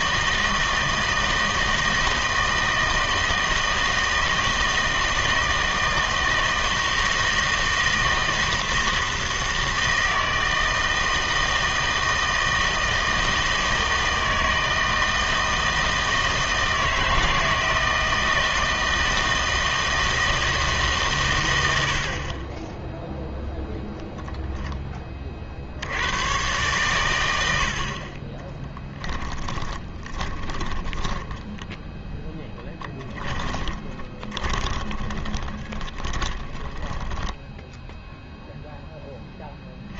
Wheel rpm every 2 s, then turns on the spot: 160, 160, 160, 160, 160, 160, 160, 160, 160, 160, 140, 10, 10, 130, 10, 10, 10, 20, 10, 0.
28-30 32-38